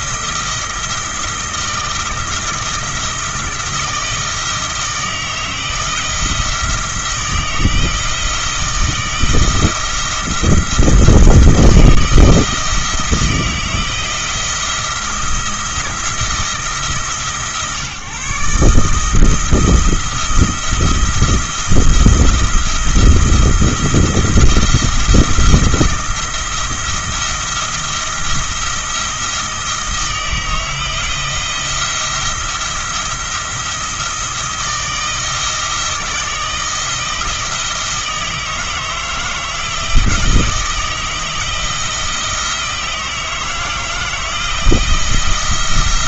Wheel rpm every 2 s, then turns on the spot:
170, 170, 160, 160, 160, 170, 160, 170, 150, 150, 170, 170, 170, 170, 170, 160, 170, 160, 170, 160, 160, 160, 170.
none